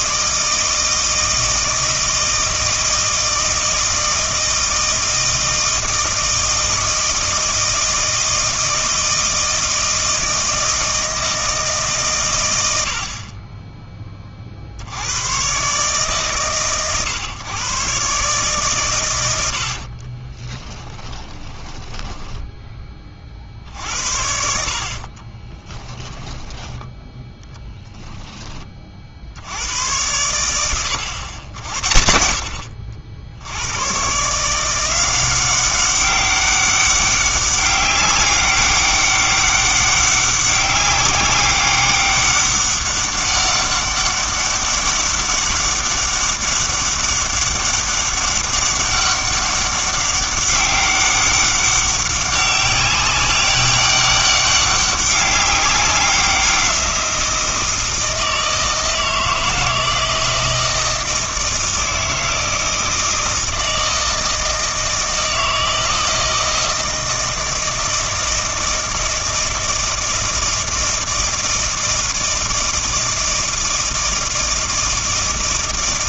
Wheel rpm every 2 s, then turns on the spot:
160, 160, 160, 160, 160, 160, 100, 60, 140, 120, 10, 20, 50, 10, 30, 110, 70, 170, 200, 200, 200, 200, 200, 200, 200, 200, 190, 200, 180, 160, 160, 160, 160, 160, 160, 160, 160, 160.
20-22